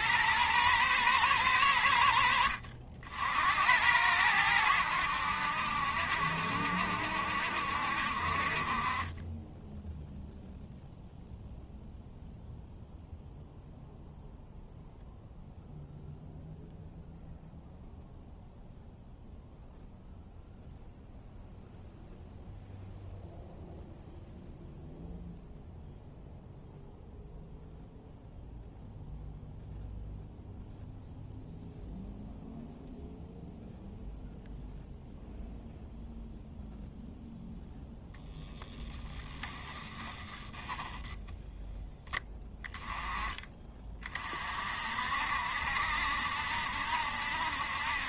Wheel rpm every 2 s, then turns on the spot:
110, 60, 90, 70, 40, 0, 0, 0, 0, 0, 0, 0, 0, 0, 0, 0, 0, 0, 0, 10, 10, 10, 50, 70.
40-42